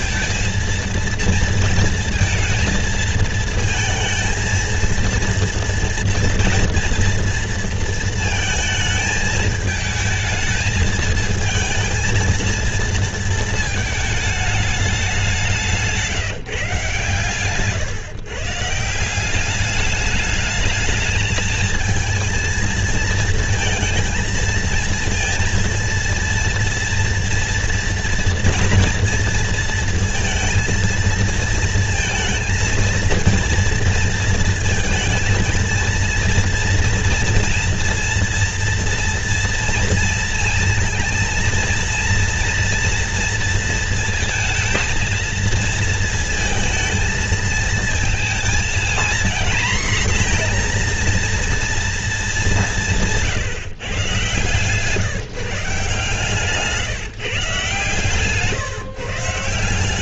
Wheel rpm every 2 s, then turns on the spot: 220, 230, 230, 240, 230, 220, 230, 210, 140, 150, 210, 230, 230, 240, 230, 230, 230, 230, 230, 230, 230, 230, 230, 230, 230, 240, 180, 140, 150, 140.
none